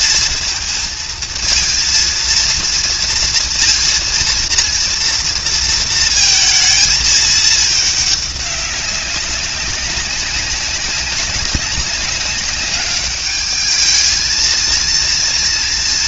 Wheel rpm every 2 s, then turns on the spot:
220, 230, 230, 220, 190, 200, 200, 230.
none